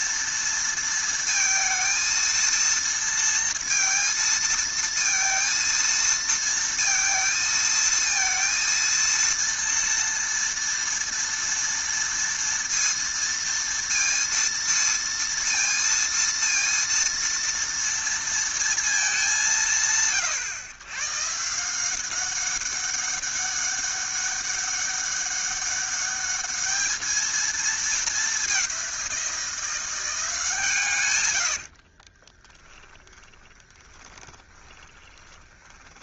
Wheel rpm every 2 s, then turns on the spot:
230, 230, 230, 230, 230, 230, 230, 230, 230, 230, 110, 190, 200, 210, 200, 150, 20, 20.
32-36